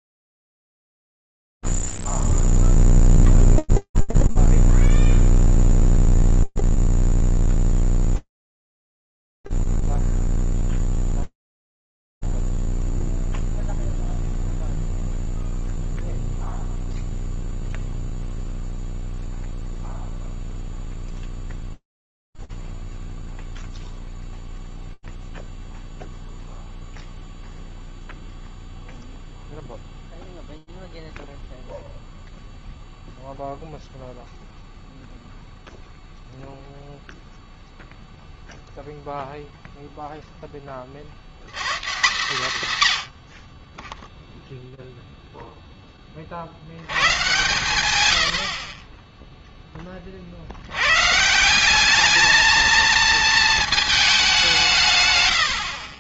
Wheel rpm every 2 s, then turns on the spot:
0, 0, 0, 0, 0, 0, 0, 0, 0, 0, 0, 0, 0, 0, 0, 0, 0, 0, 0, 0, 40, 140, 0, 120, 20, 150, 220, 110.
none